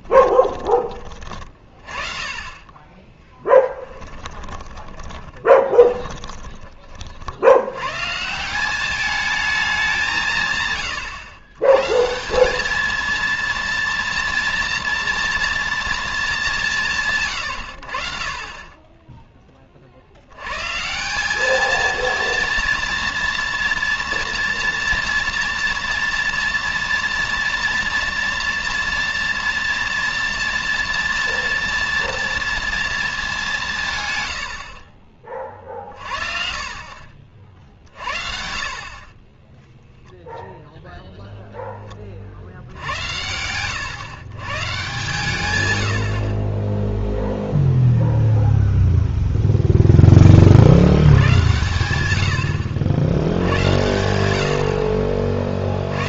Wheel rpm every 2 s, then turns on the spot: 30, 10, 20, 100, 210, 130, 230, 230, 80, 20, 210, 230, 230, 230, 240, 230, 180, 50, 60, 10, 20, 130, 80, 0, 10, 110, 90, 40.
2-6 54-56